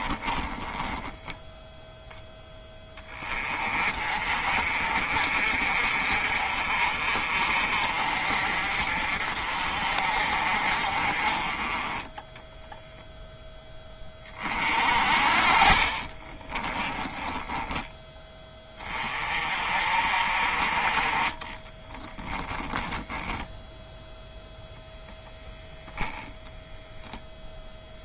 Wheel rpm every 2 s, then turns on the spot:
10, 20, 50, 40, 50, 40, 0, 40, 20, 20, 40, 10, 0, 0.
0-2 16-18 22-24